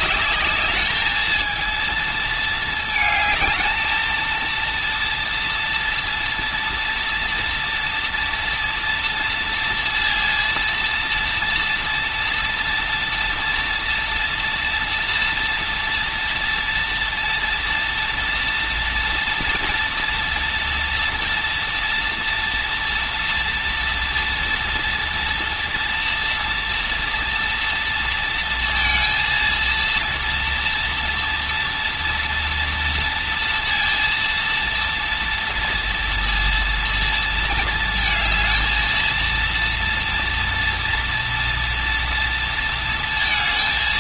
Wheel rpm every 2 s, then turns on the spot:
220, 220, 230, 240, 230, 230, 240, 230, 240, 230, 230, 230, 230, 240, 230, 230, 230, 230, 230, 220, 230, 230.
none